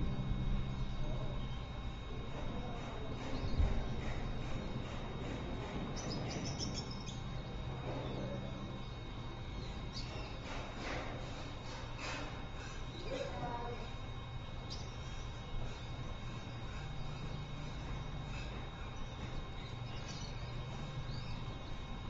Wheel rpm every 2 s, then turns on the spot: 0, 0, 0, 0, 0, 0, 0, 0, 0, 0, 0.
none